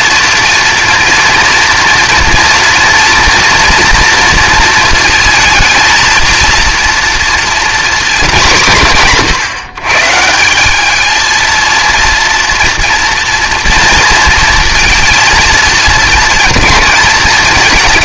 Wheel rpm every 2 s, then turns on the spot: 230, 230, 230, 230, 170, 190, 230, 230, 230.
none